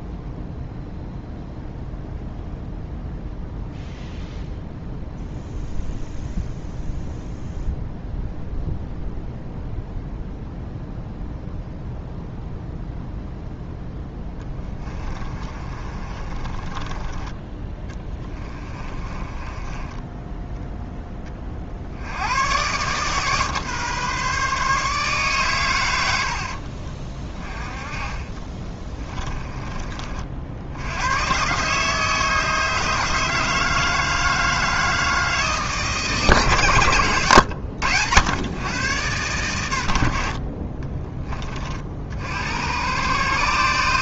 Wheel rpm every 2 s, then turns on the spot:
0, 0, 0, 0, 0, 0, 0, 20, 20, 30, 10, 120, 150, 50, 20, 70, 150, 160, 140, 110, 40, 90.
14-20 26-30